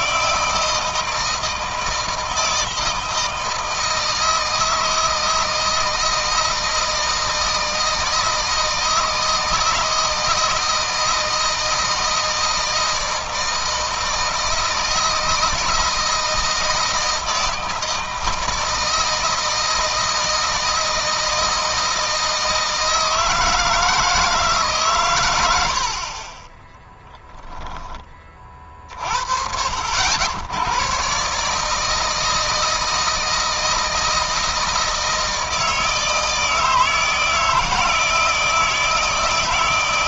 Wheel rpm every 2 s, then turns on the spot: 160, 160, 160, 160, 160, 160, 160, 160, 160, 160, 160, 160, 140, 10, 50, 110, 160, 160, 160, 160.
26-28